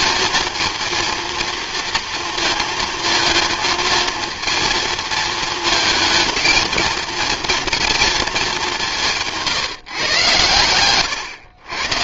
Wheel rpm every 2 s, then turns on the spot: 230, 230, 230, 220, 210, 110.
10-12